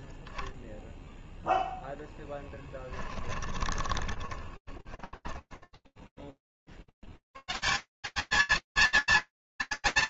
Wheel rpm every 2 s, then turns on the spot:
0, 10, 10, 30, 220.
2-6